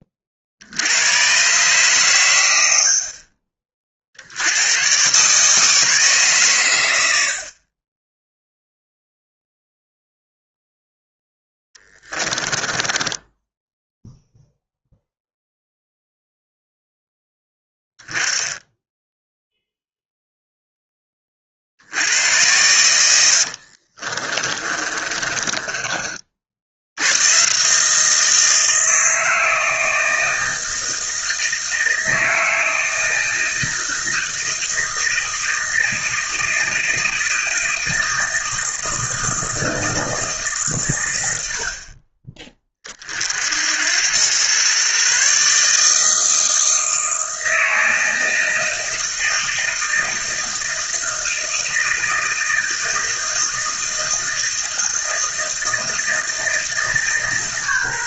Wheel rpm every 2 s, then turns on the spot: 80, 60, 110, 100, 0, 0, 10, 0, 0, 10, 10, 100, 40, 80, 160, 160, 160, 160, 160, 160, 120, 40, 130, 160, 160, 160, 160, 160, 150.
12-14 24-26